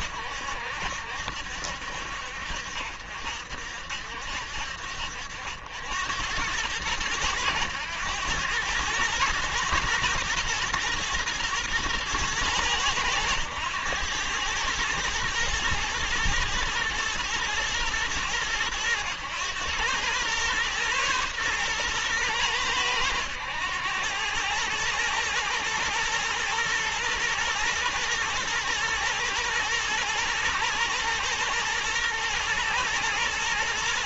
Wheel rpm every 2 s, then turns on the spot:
70, 60, 60, 100, 100, 110, 110, 110, 120, 110, 120, 110, 110, 120, 120, 110, 120.
none